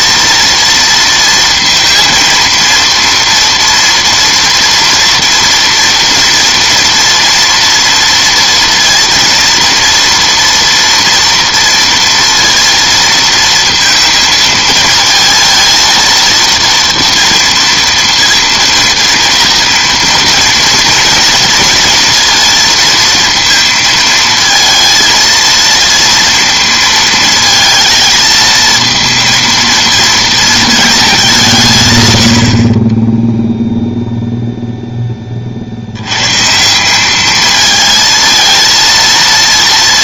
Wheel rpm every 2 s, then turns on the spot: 230, 230, 230, 230, 230, 230, 230, 220, 230, 230, 230, 230, 220, 230, 220, 230, 60, 0, 140, 220.
none